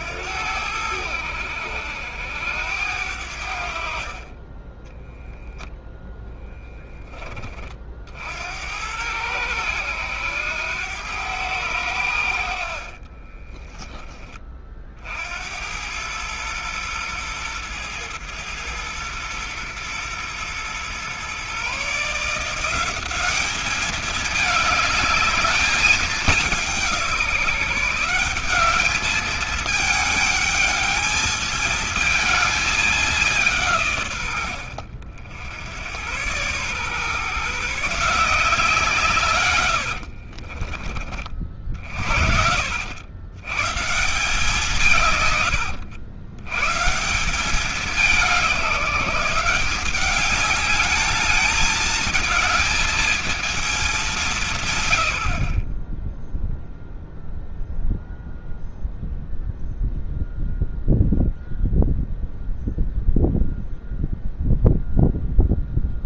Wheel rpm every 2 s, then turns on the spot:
80, 80, 20, 10, 70, 100, 60, 30, 110, 110, 120, 170, 210, 200, 200, 210, 220, 90, 120, 170, 50, 70, 160, 130, 180, 200, 220, 160, 0, 0, 0, 0, 0.
4-6 12-14 40-42